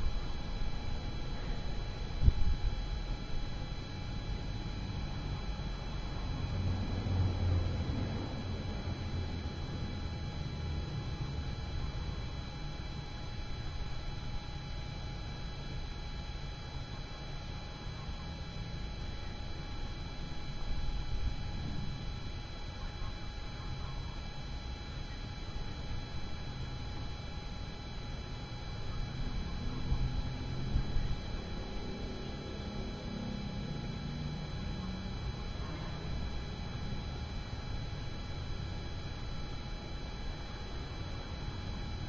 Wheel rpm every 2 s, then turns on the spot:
0, 0, 0, 0, 0, 0, 0, 0, 0, 0, 0, 0, 0, 0, 0, 0, 0, 0, 0, 0, 0.
none